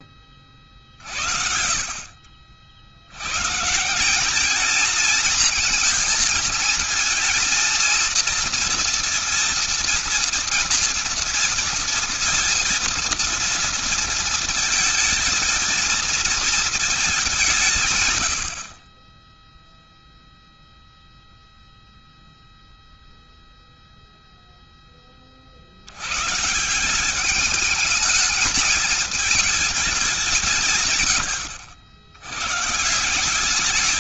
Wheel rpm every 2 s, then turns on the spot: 30, 60, 220, 220, 230, 230, 230, 220, 230, 70, 0, 0, 0, 140, 220, 170, 120.
none